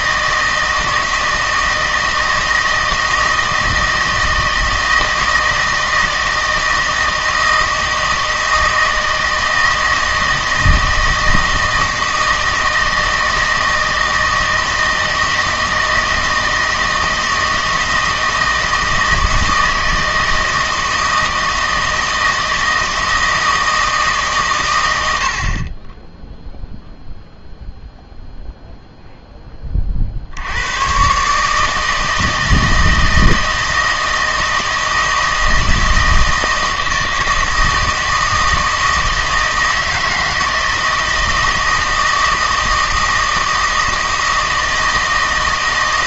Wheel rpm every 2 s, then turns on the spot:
160, 160, 160, 160, 160, 160, 160, 160, 160, 160, 160, 160, 110, 0, 0, 100, 160, 160, 160, 160, 160, 160, 160.
none